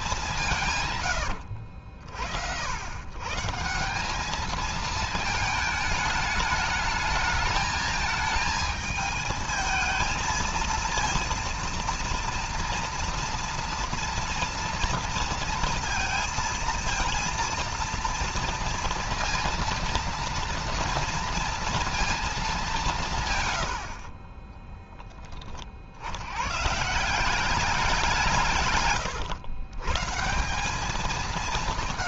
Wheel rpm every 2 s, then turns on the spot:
190, 70, 200, 210, 220, 220, 230, 230, 230, 230, 230, 220, 40, 80, 160, 150.
24-26 28-30